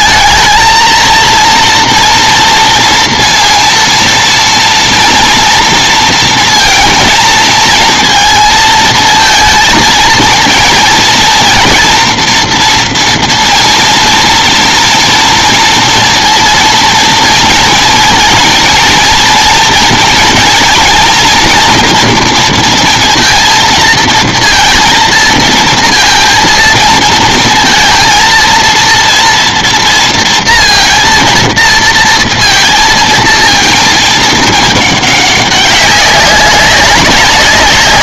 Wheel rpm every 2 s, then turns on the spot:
230, 230, 230, 230, 230, 230, 230, 230, 230, 230, 230, 230, 230, 230, 230, 230, 230, 210, 190.
none